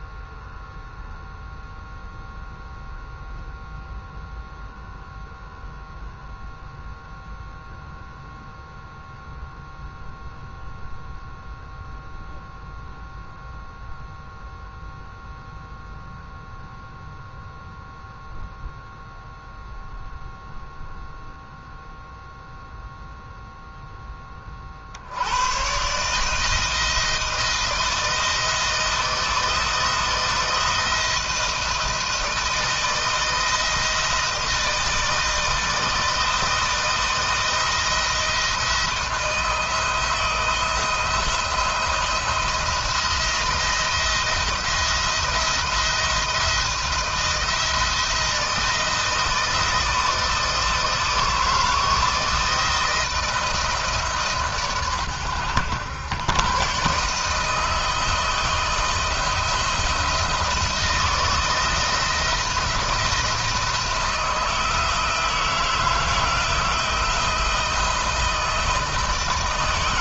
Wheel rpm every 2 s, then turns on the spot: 0, 0, 0, 0, 0, 0, 0, 0, 0, 0, 0, 0, 40, 160, 160, 170, 160, 160, 160, 170, 160, 170, 170, 170, 170, 160, 160, 140, 120, 160, 170, 170, 160, 160, 170.
none